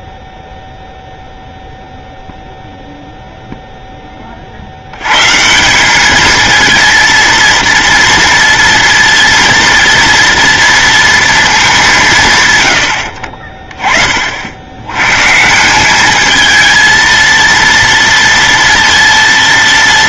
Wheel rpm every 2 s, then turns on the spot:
0, 0, 110, 230, 230, 230, 80, 130, 230, 230.
none